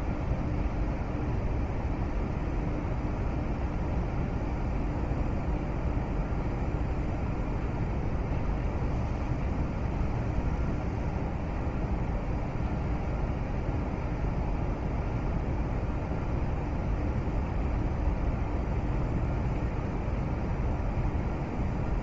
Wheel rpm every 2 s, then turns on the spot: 0, 0, 0, 0, 0, 0, 0, 0, 0, 0, 0.
none